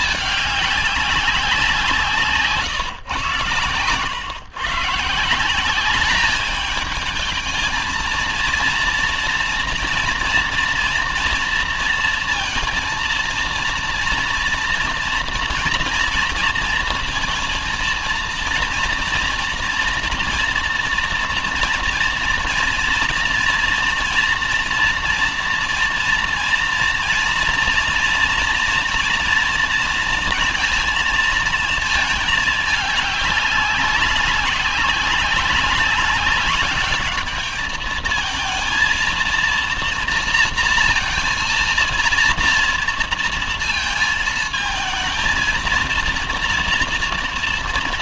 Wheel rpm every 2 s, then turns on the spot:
200, 150, 140, 210, 230, 230, 230, 230, 230, 230, 230, 230, 240, 230, 230, 230, 210, 190, 200, 220, 230, 230, 220, 230.
none